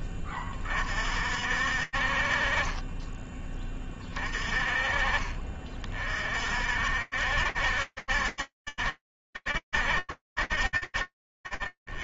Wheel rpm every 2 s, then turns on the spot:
20, 30, 30, 60, 70, 60.
none